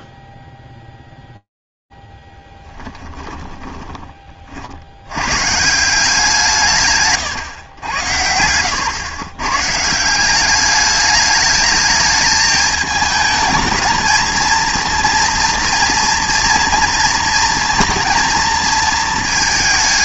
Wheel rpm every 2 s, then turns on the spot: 0, 0, 30, 160, 100, 160, 220, 220, 230, 220.
none